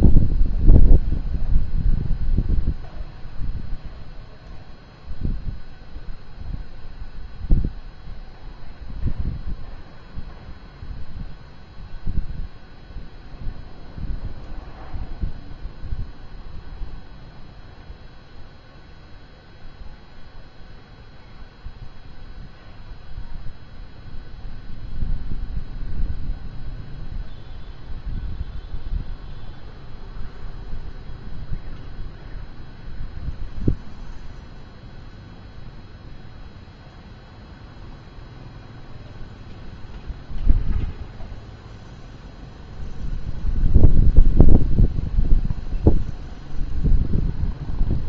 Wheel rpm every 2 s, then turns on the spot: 0, 0, 0, 0, 0, 0, 0, 0, 0, 0, 0, 0, 0, 0, 0, 0, 0, 0, 0, 0, 0, 0, 0, 0.
none